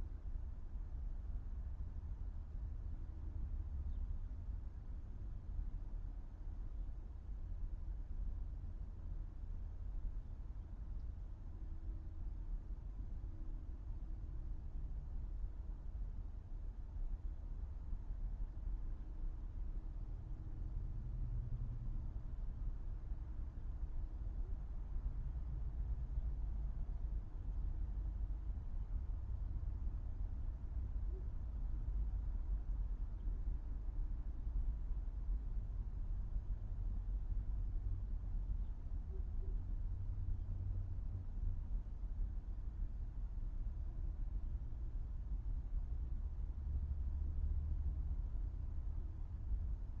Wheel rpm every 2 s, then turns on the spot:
0, 0, 0, 0, 0, 0, 0, 0, 0, 0, 0, 0, 0, 0, 0, 0, 0, 0, 0, 0, 0, 0, 0, 0, 0.
none